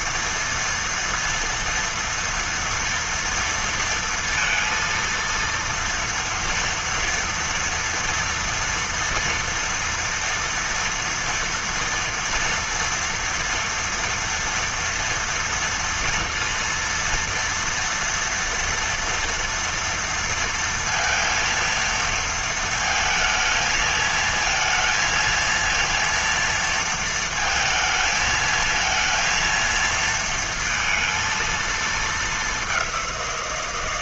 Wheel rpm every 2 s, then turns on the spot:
230, 230, 230, 230, 230, 230, 230, 230, 230, 230, 230, 230, 220, 230, 220, 230, 210.
none